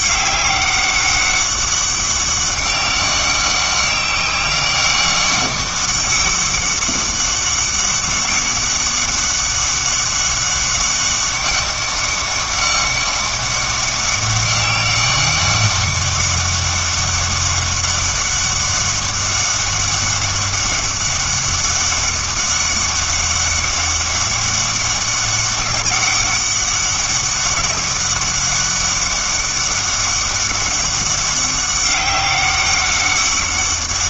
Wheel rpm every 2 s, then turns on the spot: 200, 200, 200, 200, 200, 200, 200, 200, 200, 200, 200, 200, 200, 200, 200, 200, 200.
none